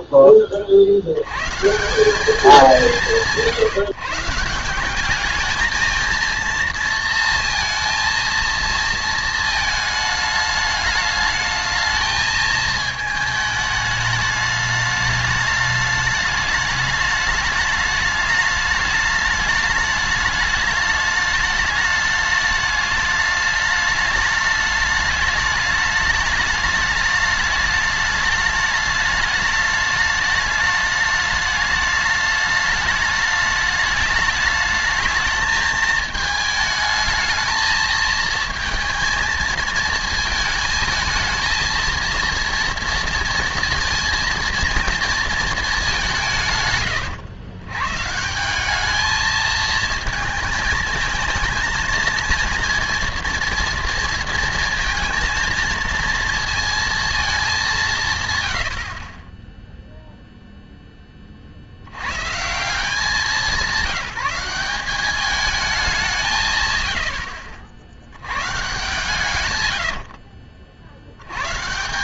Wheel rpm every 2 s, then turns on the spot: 40, 200, 180, 230, 230, 210, 220, 210, 210, 210, 210, 210, 210, 210, 210, 210, 210, 220, 220, 230, 220, 230, 230, 150, 190, 220, 230, 230, 230, 90, 0, 170, 190, 140, 130, 60.
none